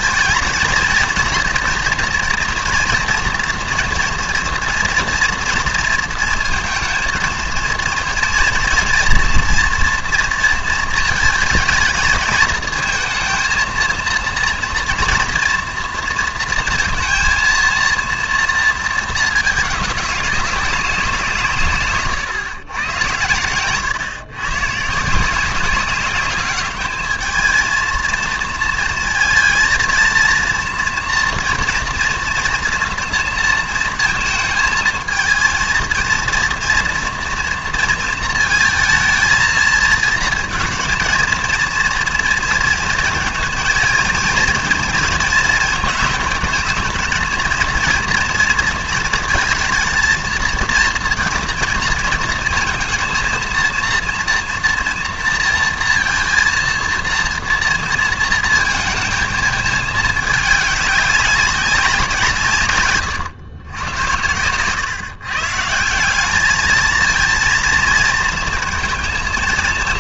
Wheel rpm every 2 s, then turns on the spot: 220, 230, 240, 230, 230, 230, 220, 230, 230, 230, 190, 120, 140, 210, 230, 230, 240, 220, 230, 230, 220, 230, 230, 220, 230, 230, 230, 230, 230, 230, 200, 140, 120, 210, 220.
none